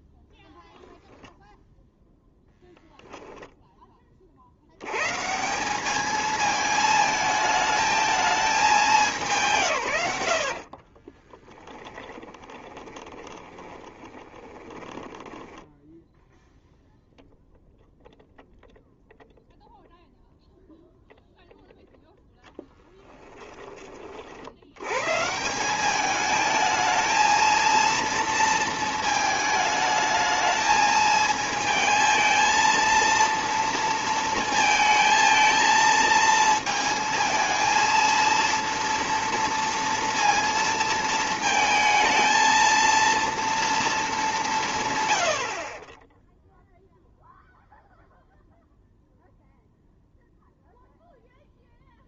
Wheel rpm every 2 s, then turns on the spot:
0, 0, 90, 220, 210, 40, 20, 20, 0, 0, 0, 10, 100, 220, 230, 220, 230, 230, 230, 230, 230, 230, 150, 0, 0, 0.
10-16